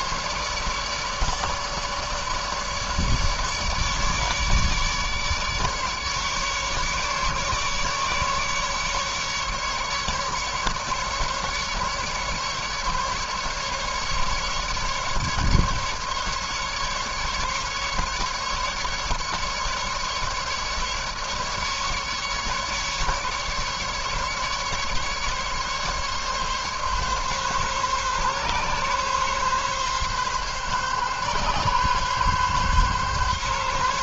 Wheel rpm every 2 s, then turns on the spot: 150, 150, 150, 150, 150, 150, 150, 140, 150, 140, 150, 150, 150, 140, 140, 140, 140.
none